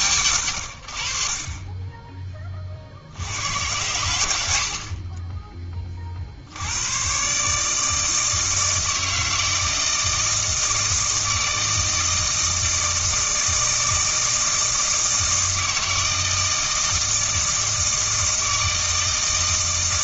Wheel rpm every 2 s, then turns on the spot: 70, 30, 60, 110, 160, 160, 160, 160, 160, 160.
none